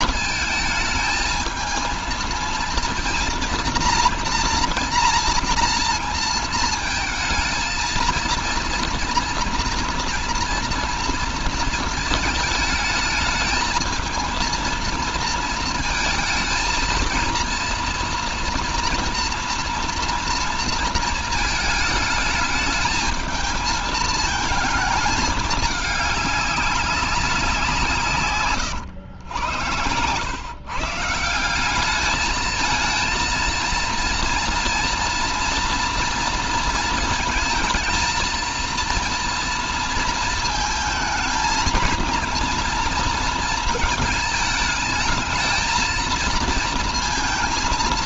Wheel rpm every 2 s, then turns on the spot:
220, 230, 230, 230, 230, 230, 220, 230, 220, 240, 230, 220, 220, 200, 120, 140, 220, 240, 230, 230, 220, 230, 220, 230.
none